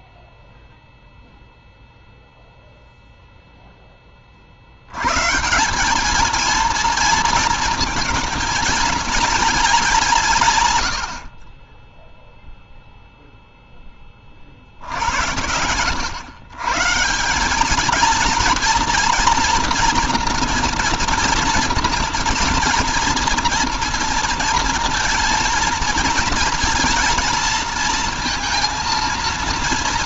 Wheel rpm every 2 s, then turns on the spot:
0, 0, 40, 220, 220, 150, 0, 50, 130, 230, 230, 230, 230, 230, 230.
none